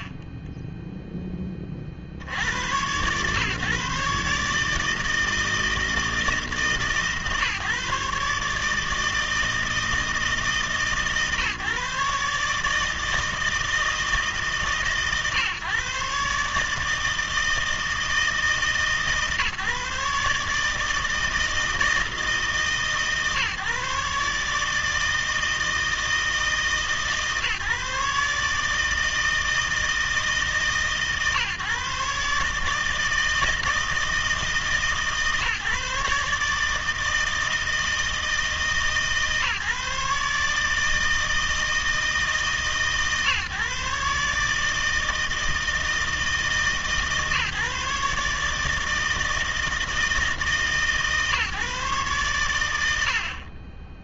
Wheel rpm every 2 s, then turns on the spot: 20, 110, 150, 160, 150, 150, 150, 140, 150, 160, 150, 160, 150, 160, 150, 150, 150, 160, 150, 160, 160, 140, 160, 150, 150, 150, 110.
0-2